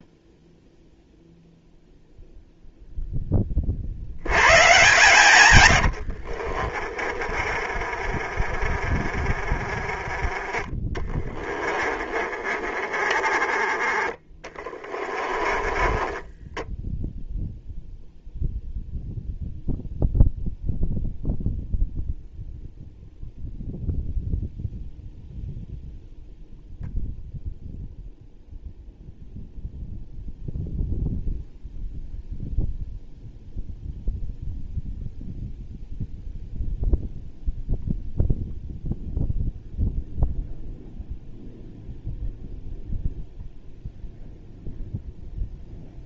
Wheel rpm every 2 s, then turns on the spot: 0, 0, 140, 30, 20, 20, 20, 20, 0, 0, 0, 0, 0, 0, 0, 0, 0, 0, 0, 0, 0, 0, 0.
4-8 10-16